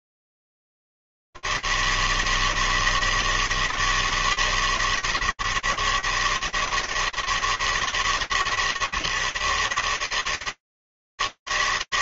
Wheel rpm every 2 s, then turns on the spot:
100, 160, 160, 150, 160, 140.
none